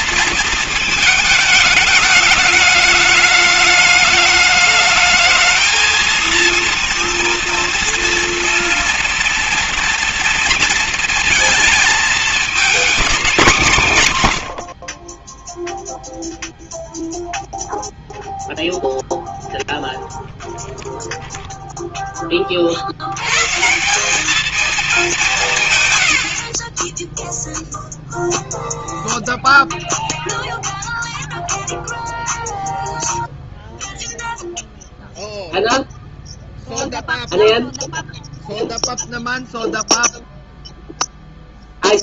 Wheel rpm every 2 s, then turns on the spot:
230, 210, 210, 230, 240, 230, 230, 100, 0, 0, 0, 20, 200, 70, 0, 0, 0, 0, 0, 0, 0.
none